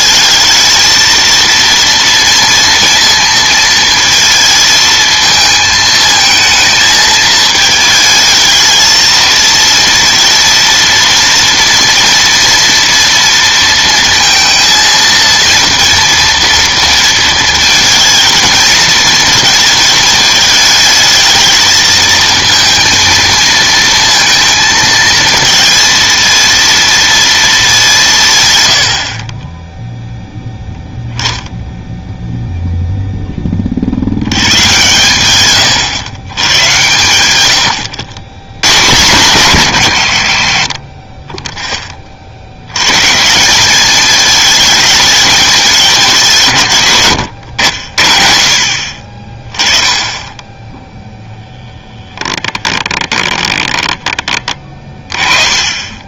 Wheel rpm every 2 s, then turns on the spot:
220, 230, 220, 230, 220, 230, 230, 230, 230, 230, 220, 230, 230, 230, 100, 10, 0, 120, 120, 120, 40, 90, 220, 150, 50, 10, 20, 20.
52-54